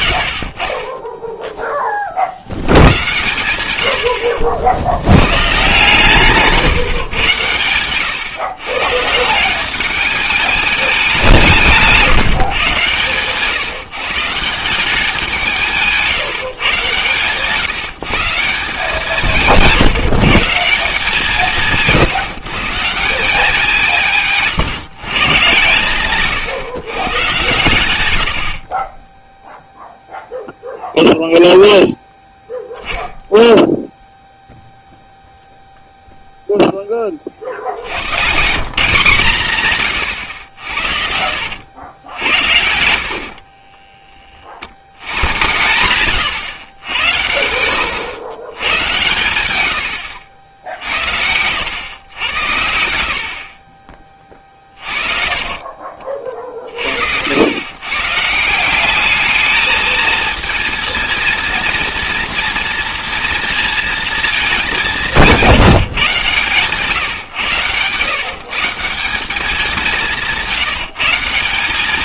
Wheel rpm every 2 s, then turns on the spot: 30, 100, 80, 140, 140, 210, 140, 180, 130, 170, 170, 160, 150, 140, 30, 0, 0, 0, 0, 170, 70, 80, 60, 110, 110, 60, 90, 30, 60, 170, 230, 230, 210, 140, 160, 150.
40-42 56-58